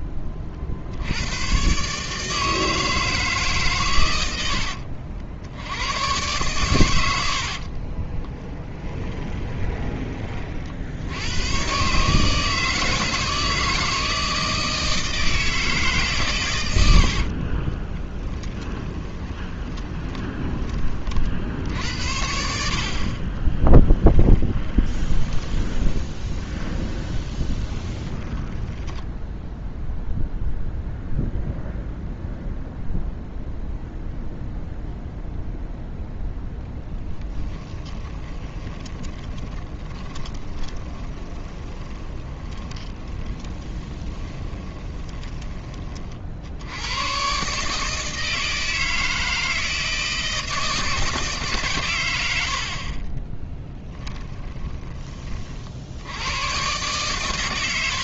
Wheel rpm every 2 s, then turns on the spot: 40, 160, 70, 120, 10, 60, 160, 160, 100, 20, 20, 60, 10, 20, 10, 0, 0, 0, 10, 20, 20, 20, 20, 100, 160, 160, 50, 20, 130.
4-6 8-10 16-20 24-30 38-46